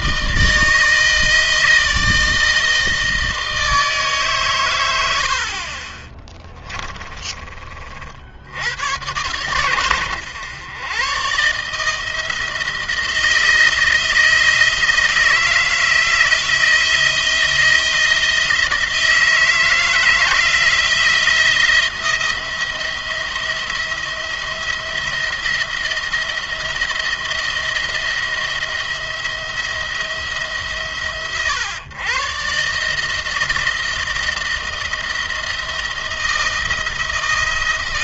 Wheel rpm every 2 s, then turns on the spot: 160, 160, 120, 20, 90, 110, 160, 160, 160, 160, 160, 170, 170, 170, 170, 150, 140, 160, 160.
6-8